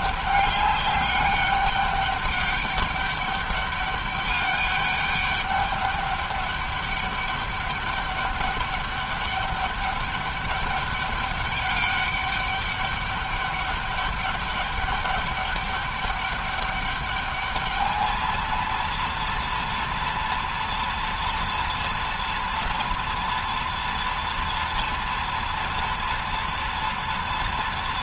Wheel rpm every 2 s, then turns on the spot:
200, 200, 200, 200, 200, 200, 200, 200, 210, 230, 230, 230, 240, 230.
none